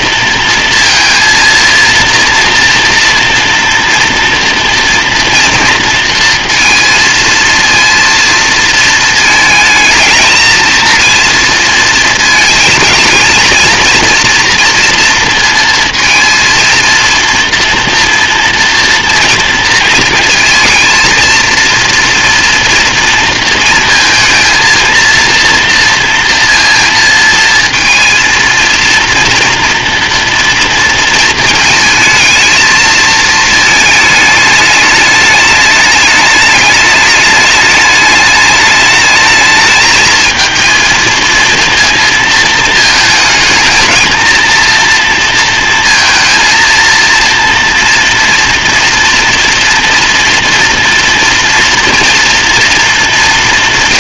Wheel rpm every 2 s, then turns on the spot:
230, 230, 230, 230, 230, 220, 220, 230, 230, 230, 230, 230, 230, 230, 230, 240, 220, 210, 210, 210, 220, 220, 230, 230, 230, 230, 230.
none